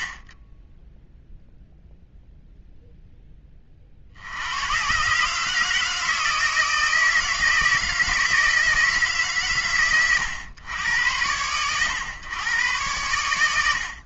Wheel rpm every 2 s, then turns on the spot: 50, 0, 100, 160, 160, 100, 100.
none